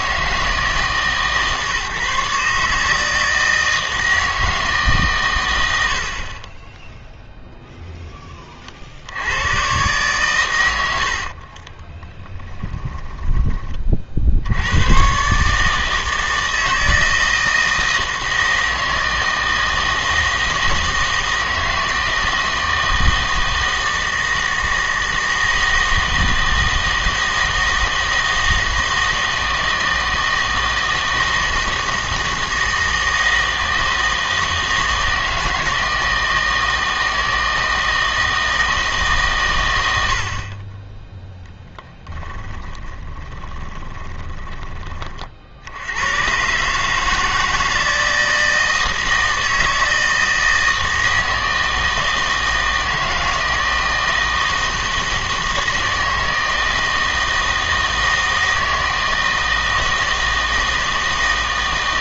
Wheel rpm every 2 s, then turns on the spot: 160, 150, 160, 20, 30, 110, 10, 90, 160, 160, 160, 160, 160, 160, 160, 160, 160, 160, 160, 160, 20, 20, 20, 140, 160, 160, 160, 160, 160, 160, 160.
12-14 42-44